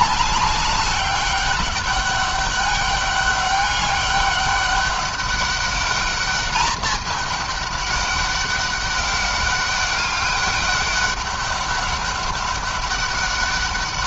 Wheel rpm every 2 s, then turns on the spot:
200, 200, 200, 210, 200, 190, 200.
none